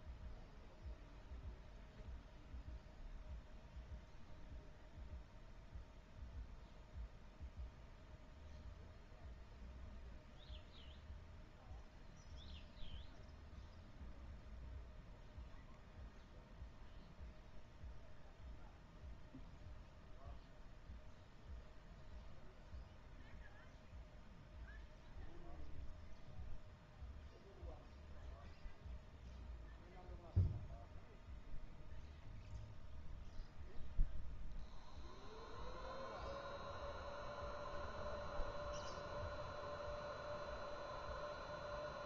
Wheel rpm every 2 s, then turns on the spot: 0, 0, 0, 0, 0, 0, 0, 0, 0, 0, 0, 0, 0, 0, 0, 0, 0, 0, 0, 0, 0.
none